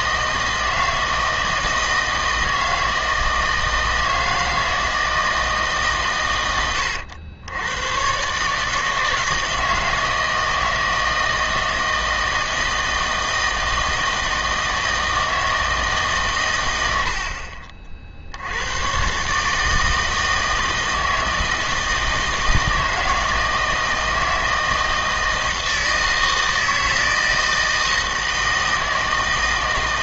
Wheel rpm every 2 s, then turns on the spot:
160, 160, 160, 100, 150, 160, 160, 160, 110, 90, 160, 160, 160, 160, 160.
none